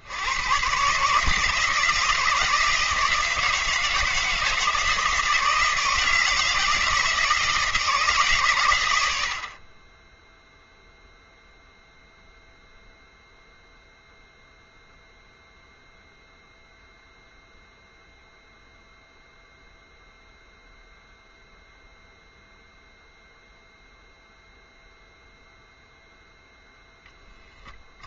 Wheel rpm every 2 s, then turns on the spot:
130, 160, 160, 160, 110, 0, 0, 0, 0, 0, 0, 0, 0, 0.
none